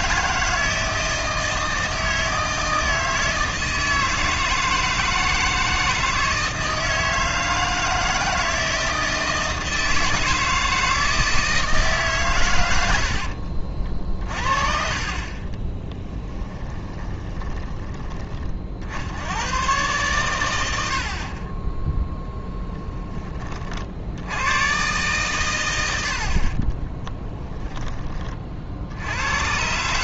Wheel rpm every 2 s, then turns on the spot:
160, 160, 160, 160, 160, 160, 100, 40, 20, 50, 100, 10, 110, 30, 60.
16-18 26-28